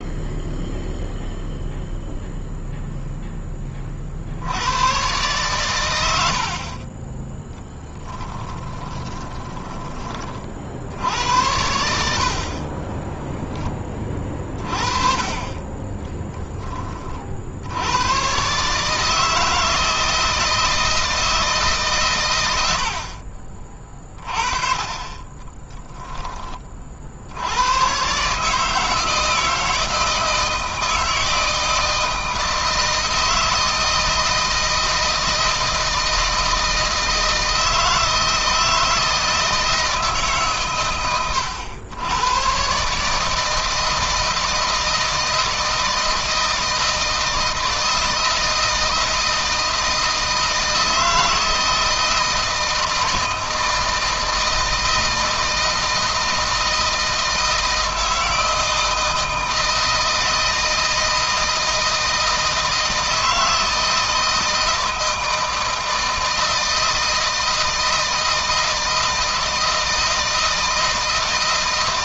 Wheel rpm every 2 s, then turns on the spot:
0, 0, 110, 20, 20, 80, 30, 30, 20, 150, 160, 50, 20, 50, 160, 160, 160, 160, 160, 160, 120, 140, 160, 160, 160, 160, 160, 160, 160, 160, 160, 160, 160, 160, 160, 160.
8-10 12-14 22-24